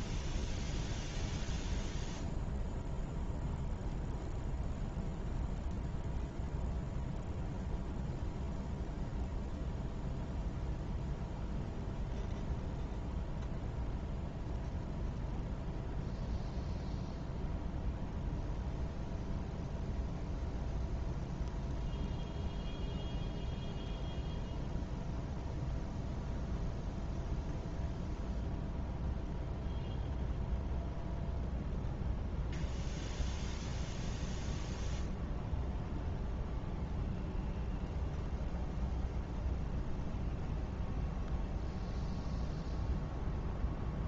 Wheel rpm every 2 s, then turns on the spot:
0, 0, 0, 0, 0, 0, 0, 0, 0, 0, 0, 0, 0, 0, 0, 0, 0, 0, 0, 0, 0, 0.
none